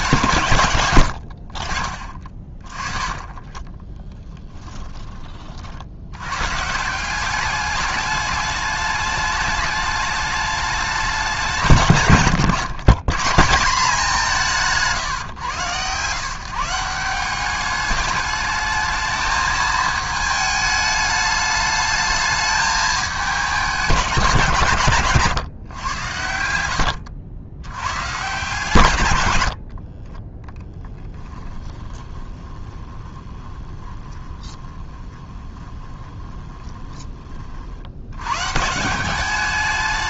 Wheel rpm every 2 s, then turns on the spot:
120, 20, 10, 140, 210, 210, 150, 160, 160, 210, 210, 210, 160, 80, 140, 10, 20, 20, 20, 130.
26-28 30-38